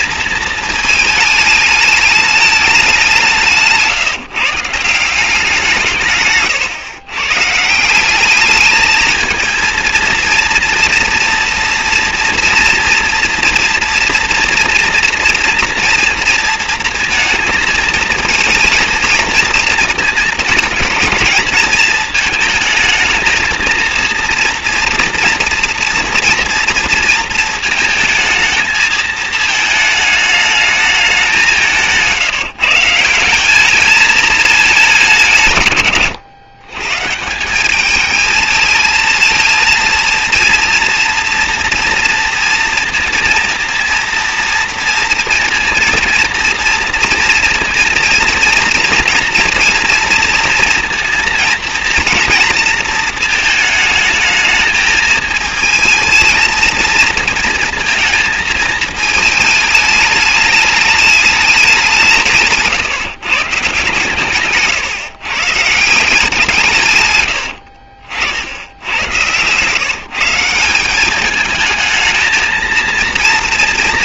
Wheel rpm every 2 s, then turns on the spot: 220, 190, 170, 120, 220, 230, 230, 230, 230, 220, 220, 220, 230, 230, 220, 210, 160, 200, 140, 220, 230, 230, 230, 230, 230, 230, 230, 220, 230, 220, 210, 150, 130, 130, 100, 180, 230.
none